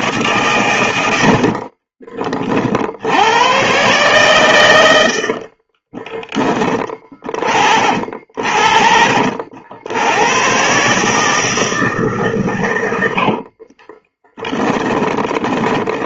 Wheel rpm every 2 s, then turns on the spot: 100, 70, 70, 20, 60, 150, 90, 20.
4-6 12-16